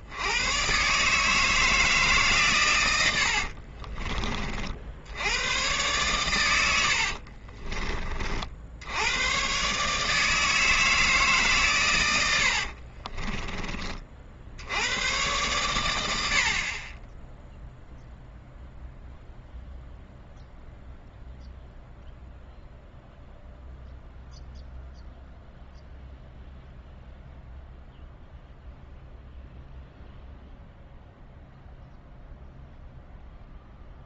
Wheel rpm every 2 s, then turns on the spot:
110, 130, 50, 100, 60, 160, 70, 70, 50, 0, 0, 0, 0, 0, 0, 0, 0.
12-14